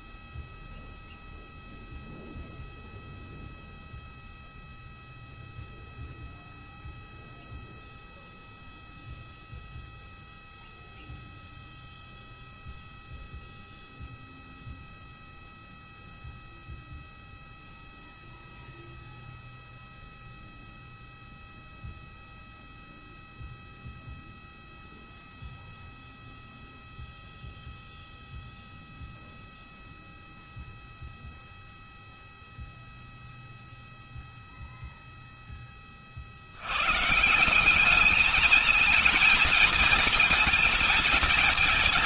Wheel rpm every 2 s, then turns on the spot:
0, 0, 0, 0, 0, 0, 0, 0, 0, 0, 0, 0, 0, 0, 0, 0, 0, 0, 90, 220, 230.
none